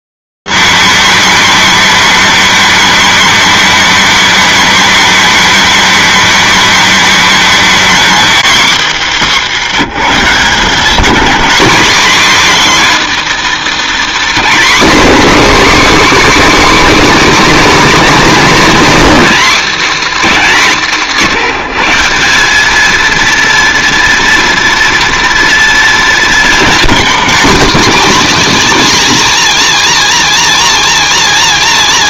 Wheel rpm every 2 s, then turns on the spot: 280, 280, 290, 280, 290, 200, 270, 310, 290, 270, 280, 200, 230, 230, 280, 280.
none